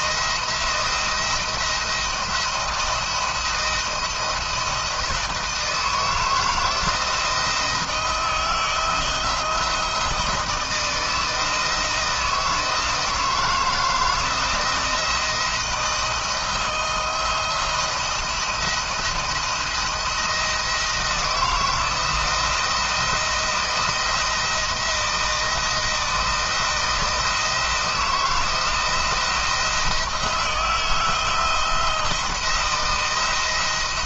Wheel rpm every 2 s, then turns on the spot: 170, 170, 170, 160, 160, 160, 160, 160, 160, 170, 170, 170, 160, 170, 170, 160, 170.
none